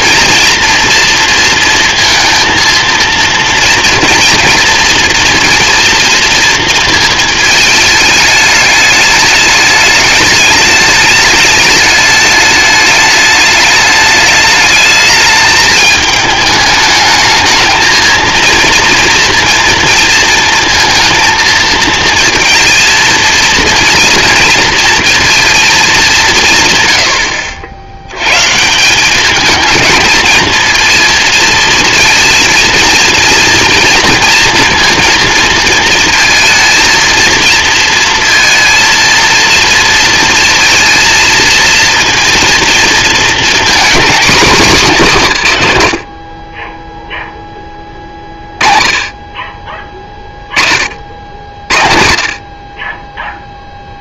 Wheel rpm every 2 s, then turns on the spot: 230, 230, 230, 220, 210, 210, 210, 210, 210, 230, 230, 230, 230, 120, 170, 230, 230, 230, 230, 230, 230, 230, 210, 10, 30, 30, 40.
none